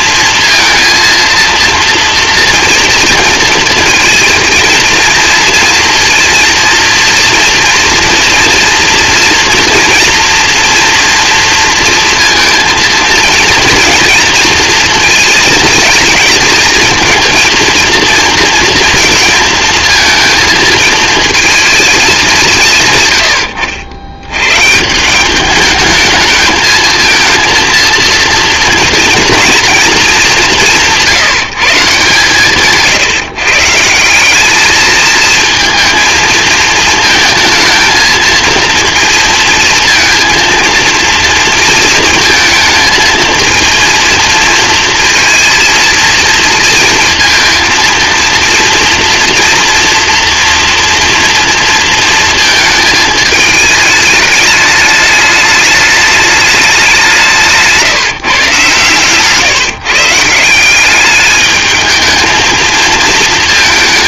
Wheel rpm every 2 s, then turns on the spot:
230, 230, 230, 230, 240, 230, 230, 230, 230, 230, 230, 130, 160, 220, 230, 160, 150, 210, 220, 230, 230, 220, 230, 230, 230, 230, 220, 220, 200, 140, 200, 230.
none